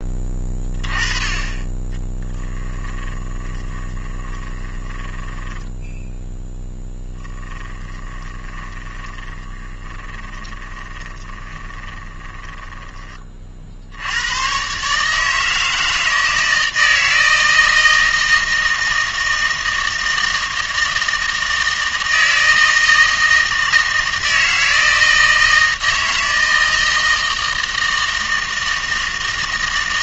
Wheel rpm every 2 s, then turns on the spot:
30, 20, 20, 10, 20, 20, 20, 130, 160, 160, 160, 160, 160, 160, 160.
2-6 8-14